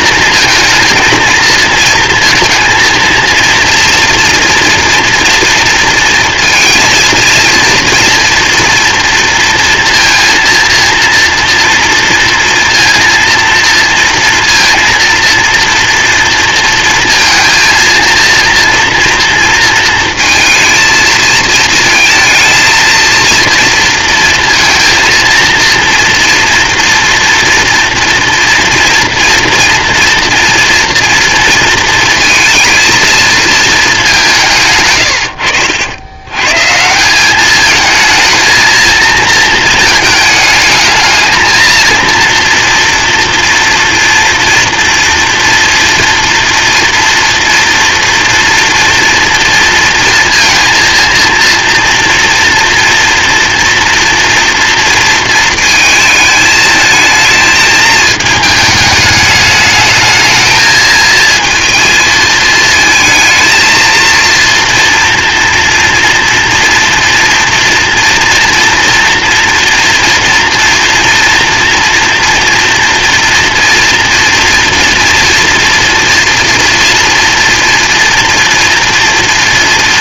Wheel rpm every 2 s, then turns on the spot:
230, 230, 230, 230, 230, 230, 230, 230, 230, 230, 230, 230, 230, 230, 230, 230, 220, 150, 140, 230, 220, 240, 230, 230, 230, 230, 230, 230, 220, 220, 220, 220, 240, 240, 230, 230, 240, 230, 230, 230.
none